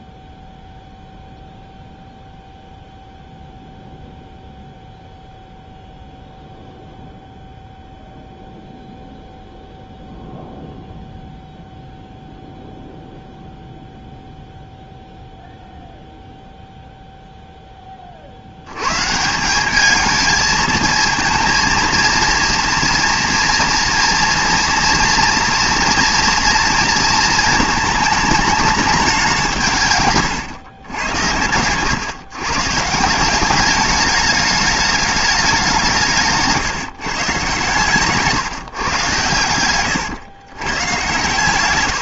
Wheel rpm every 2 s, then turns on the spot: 0, 0, 0, 0, 0, 0, 0, 0, 0, 90, 220, 230, 230, 230, 220, 110, 150, 210, 150, 140, 110.
none